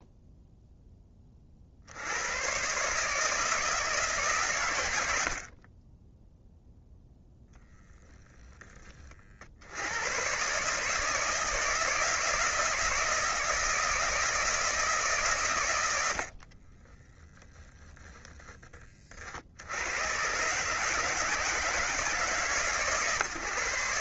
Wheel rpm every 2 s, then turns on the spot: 20, 140, 90, 0, 40, 160, 160, 150, 10, 40, 150, 140.
16-18